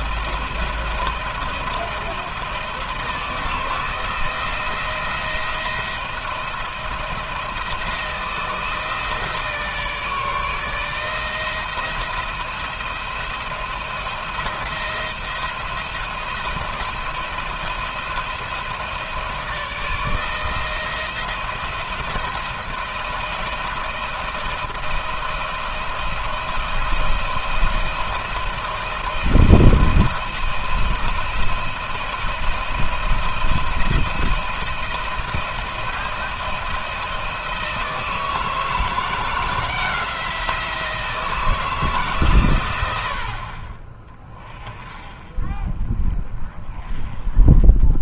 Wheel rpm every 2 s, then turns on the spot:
170, 170, 170, 170, 160, 160, 170, 170, 170, 160, 160, 160, 170, 170, 170, 170, 170, 170, 170, 160, 170, 120, 30, 30.
none